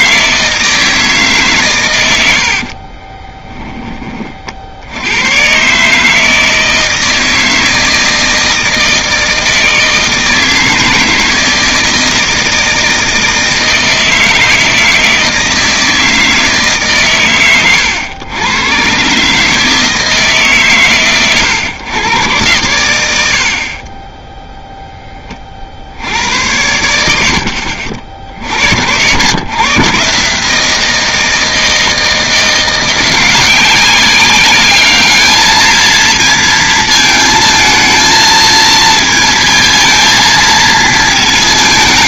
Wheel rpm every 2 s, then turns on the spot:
160, 60, 50, 160, 160, 160, 160, 160, 150, 110, 150, 110, 0, 90, 70, 150, 170, 200, 230, 220, 220.
2-4